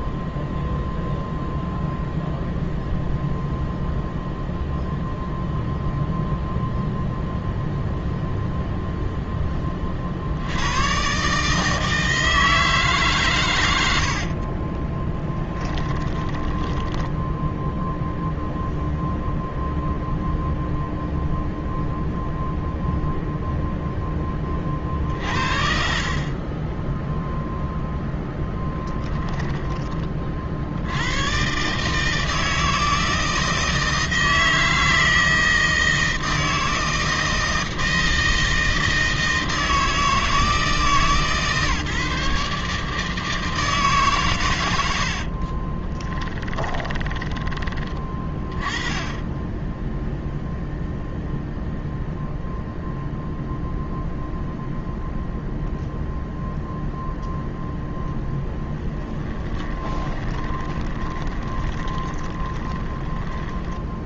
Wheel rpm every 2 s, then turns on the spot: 0, 0, 0, 0, 0, 60, 160, 70, 20, 0, 0, 0, 20, 40, 0, 40, 160, 160, 160, 160, 160, 150, 130, 20, 30, 0, 0, 0, 0, 10, 10, 20.
14-18 46-48 60-64